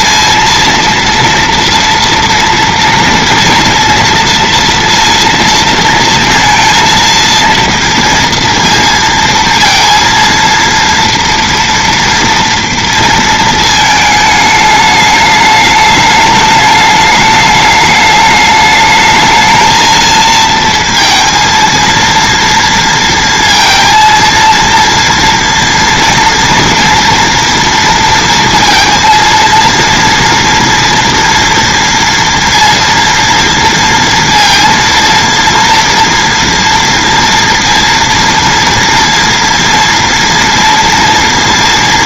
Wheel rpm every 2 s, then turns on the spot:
230, 230, 230, 230, 230, 230, 230, 210, 210, 210, 230, 230, 230, 230, 230, 240, 230, 230, 230, 230, 230.
none